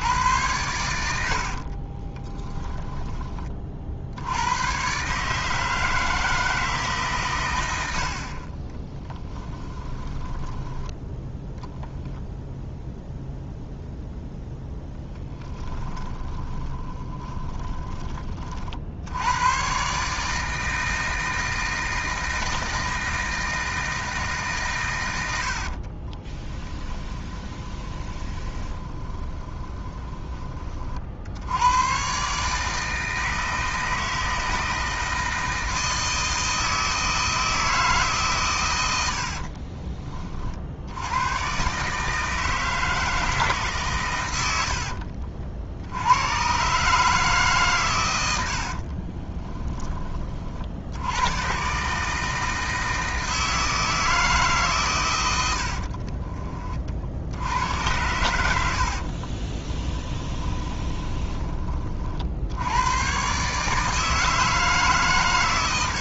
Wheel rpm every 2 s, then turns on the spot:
100, 10, 120, 160, 30, 10, 0, 0, 20, 60, 160, 160, 130, 10, 20, 30, 150, 160, 160, 100, 70, 160, 90, 140, 60, 60, 160, 130, 40, 70, 20, 90, 160.
2-4 8-12 16-18 26-30 44-46 48-50 60-62